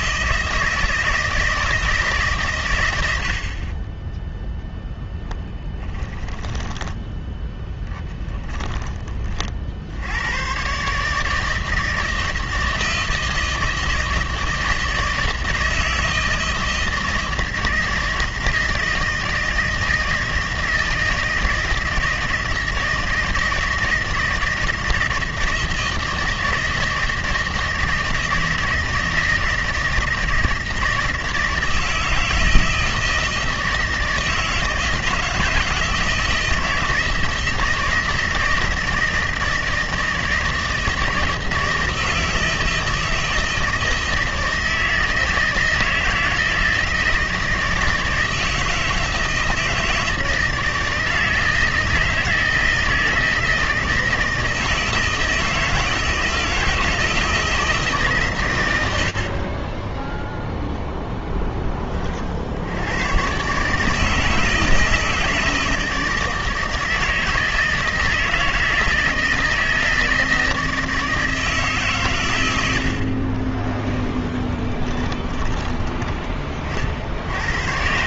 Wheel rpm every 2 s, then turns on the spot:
160, 120, 0, 10, 20, 120, 160, 160, 160, 160, 160, 160, 160, 160, 160, 160, 160, 160, 160, 160, 160, 160, 160, 160, 160, 160, 160, 160, 160, 110, 0, 80, 160, 160, 160, 160, 70, 20, 60.
6-10 72-76